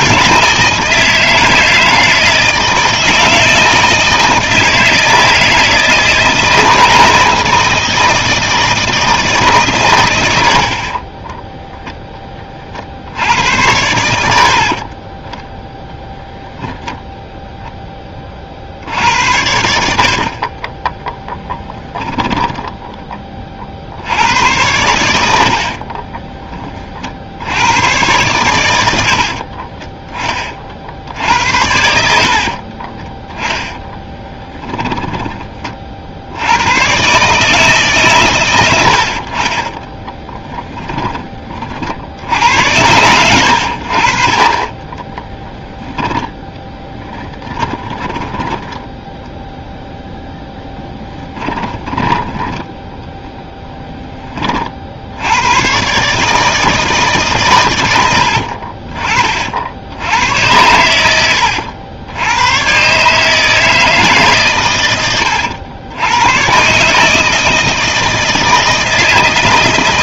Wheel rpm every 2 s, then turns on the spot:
160, 160, 160, 160, 160, 60, 40, 50, 0, 50, 30, 10, 100, 30, 110, 40, 40, 10, 100, 100, 20, 80, 30, 10, 10, 0, 10, 40, 160, 50, 90, 120, 120, 130, 160.
10-12 20-24 32-36 40-42 48-50